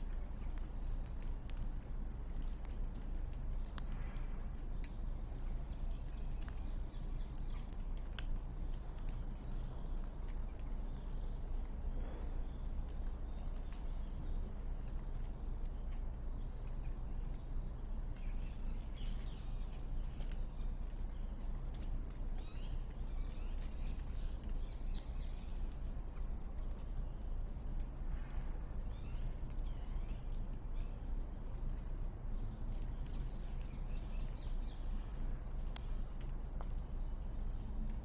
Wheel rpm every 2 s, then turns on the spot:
0, 0, 0, 0, 0, 0, 0, 0, 0, 0, 0, 0, 0, 0, 0, 0, 0, 0, 0.
none